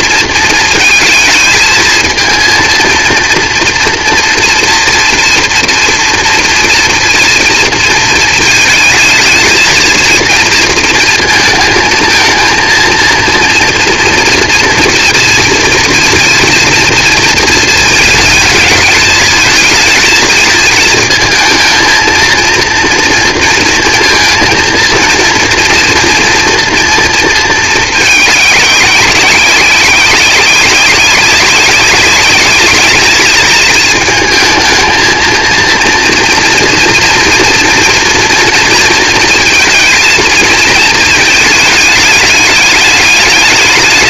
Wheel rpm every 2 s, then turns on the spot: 220, 230, 230, 230, 220, 220, 220, 230, 230, 220, 220, 230, 230, 230, 210, 190, 210, 220, 230, 230, 220, 210.
none